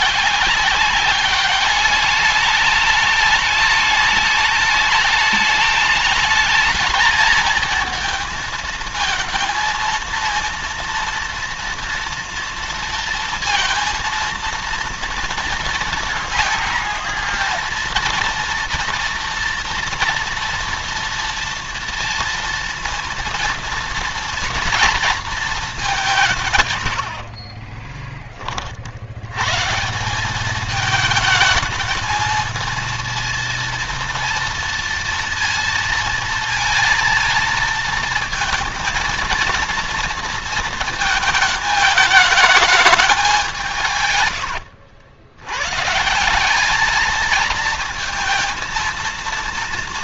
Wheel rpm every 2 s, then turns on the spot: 200, 210, 210, 220, 230, 230, 230, 230, 230, 230, 230, 230, 230, 90, 70, 210, 230, 230, 230, 230, 220, 210, 80, 210, 230.
none